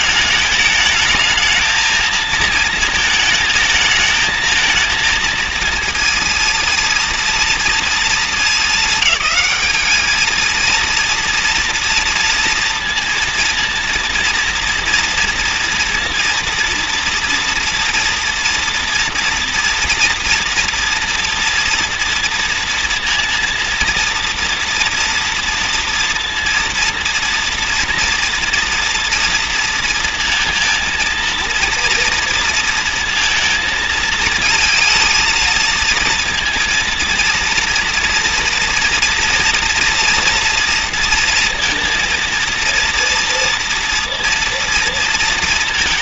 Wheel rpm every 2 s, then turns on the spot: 220, 220, 220, 230, 200, 230, 230, 230, 230, 240, 230, 230, 230, 230, 230, 230, 230, 220, 230, 230, 230, 230, 230.
none